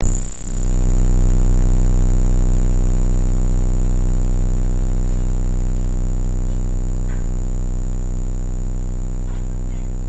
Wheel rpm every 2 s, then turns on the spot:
0, 0, 0, 0, 0.
none